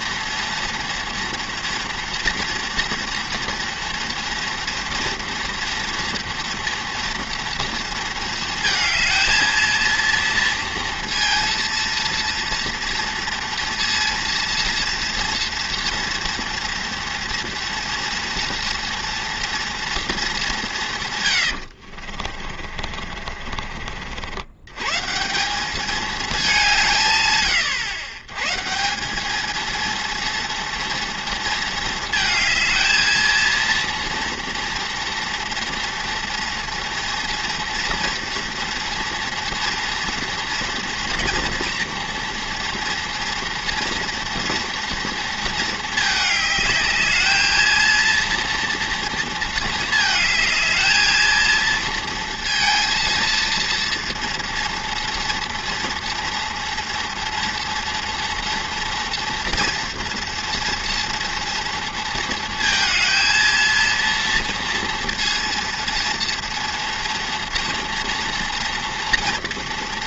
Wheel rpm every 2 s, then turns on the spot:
230, 240, 230, 230, 220, 230, 230, 230, 230, 230, 130, 40, 140, 150, 190, 230, 230, 230, 230, 230, 230, 230, 230, 210, 230, 220, 230, 230, 230, 230, 230, 230, 230, 230, 230.
20-24